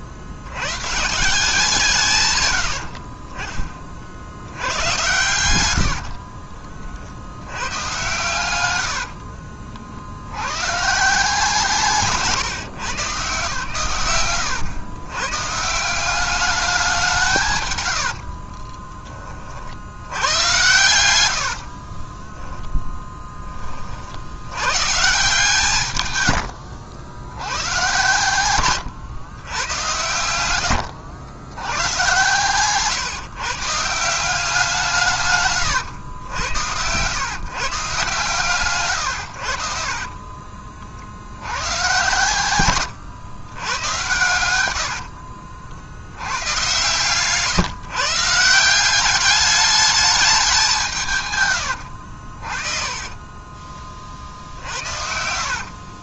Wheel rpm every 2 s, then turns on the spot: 80, 80, 100, 40, 100, 130, 130, 110, 200, 30, 90, 0, 120, 80, 110, 90, 140, 180, 90, 130, 40, 110, 80, 130, 180, 180, 30, 60.
2-4 18-22 26-28 30-32 42-46 52-56